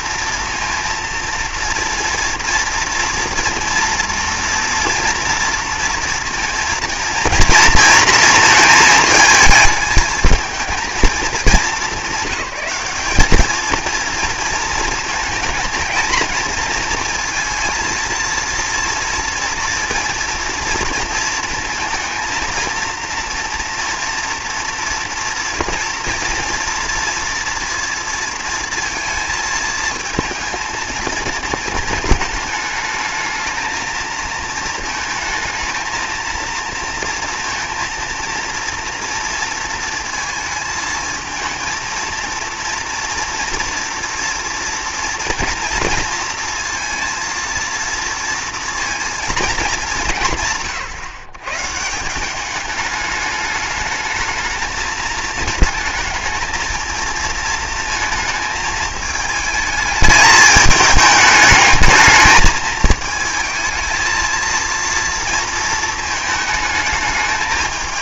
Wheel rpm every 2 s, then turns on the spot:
230, 230, 230, 230, 220, 210, 230, 220, 230, 230, 230, 230, 230, 230, 220, 220, 220, 220, 230, 230, 230, 230, 230, 230, 220, 140, 210, 220, 230, 220, 210, 220, 230, 220.
none